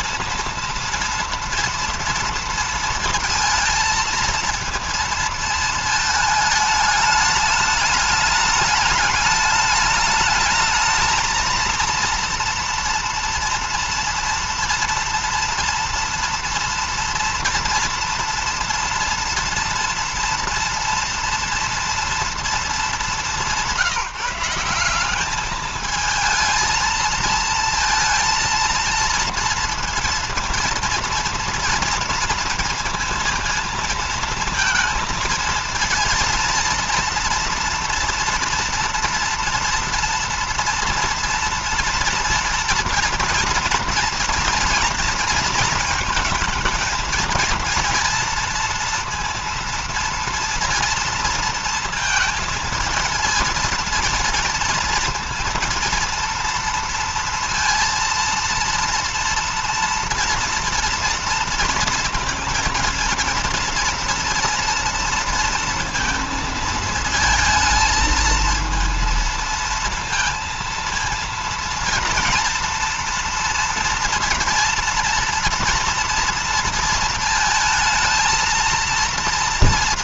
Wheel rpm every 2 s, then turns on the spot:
230, 230, 230, 210, 210, 220, 230, 230, 240, 230, 240, 220, 190, 220, 230, 230, 230, 230, 230, 230, 230, 230, 230, 230, 230, 230, 230, 230, 230, 230, 240, 230, 230, 220, 220, 230, 230, 230, 230, 230.
none